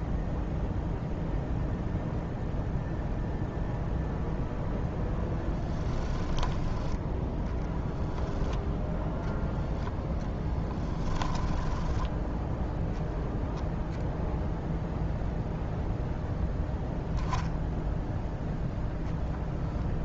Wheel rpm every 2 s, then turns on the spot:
0, 0, 0, 10, 0, 10, 0, 0, 0, 0.
10-12